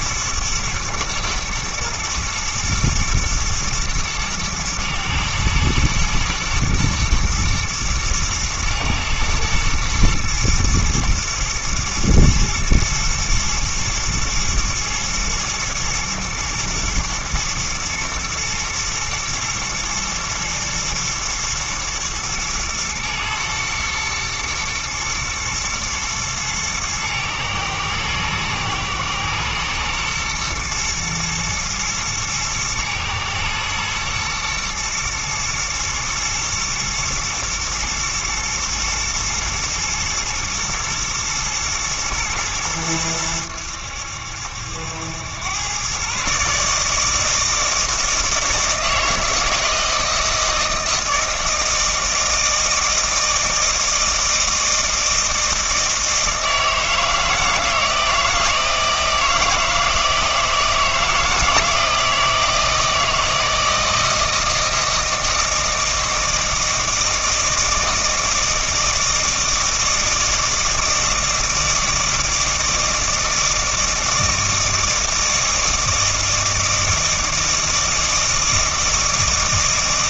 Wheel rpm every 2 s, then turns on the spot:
110, 120, 110, 110, 120, 120, 120, 120, 110, 110, 110, 110, 110, 110, 110, 110, 110, 110, 110, 110, 110, 110, 80, 150, 160, 160, 160, 160, 160, 160, 160, 160, 160, 160, 160, 160, 160, 160, 160, 160.
none